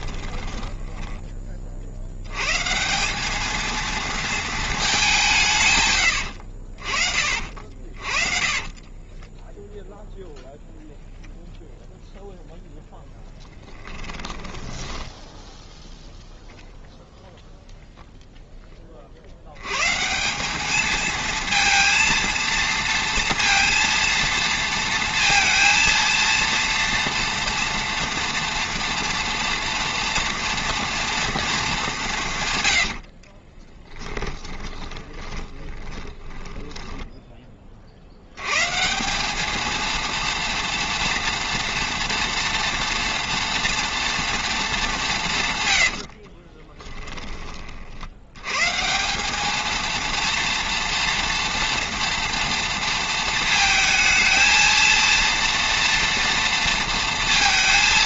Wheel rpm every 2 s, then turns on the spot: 10, 140, 220, 60, 30, 0, 10, 10, 0, 20, 210, 230, 230, 230, 230, 230, 110, 20, 10, 130, 230, 230, 220, 30, 130, 230, 230, 230, 230.
0-2 8-10 14-16 32-38 46-48